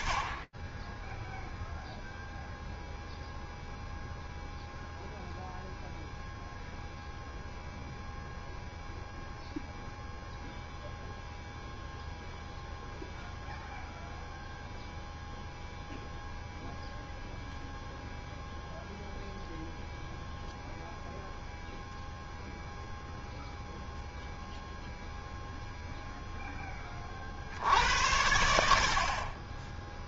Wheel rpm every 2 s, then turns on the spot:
0, 0, 0, 0, 0, 0, 0, 0, 0, 0, 0, 0, 0, 60, 20.
none